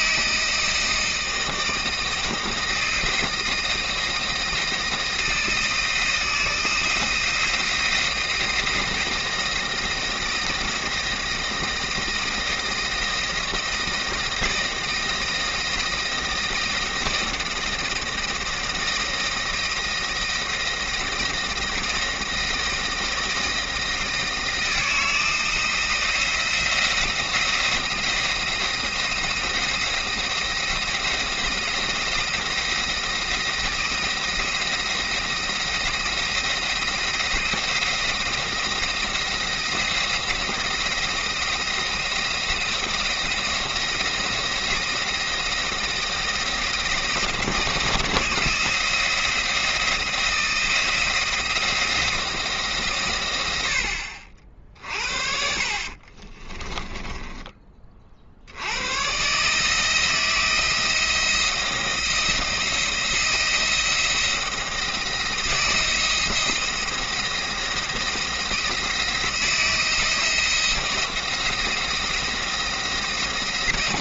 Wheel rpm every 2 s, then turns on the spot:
160, 170, 160, 160, 160, 160, 170, 160, 170, 160, 170, 160, 160, 170, 170, 170, 170, 170, 170, 170, 170, 170, 170, 170, 170, 170, 150, 50, 20, 90, 170, 170, 170, 170, 160, 170, 170.
56-58